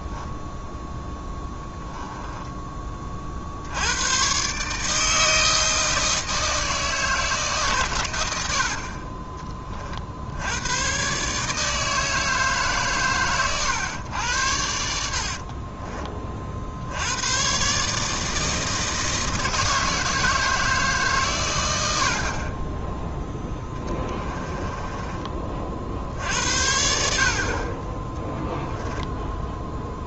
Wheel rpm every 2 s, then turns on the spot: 0, 20, 150, 160, 50, 110, 140, 80, 70, 160, 150, 10, 20, 70, 20.
8-10 14-16 24-26 28-30